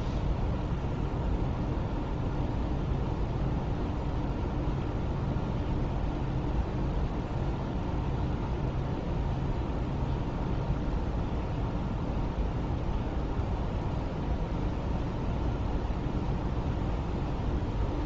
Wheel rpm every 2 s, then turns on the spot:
0, 0, 0, 0, 0, 0, 0, 0, 0.
none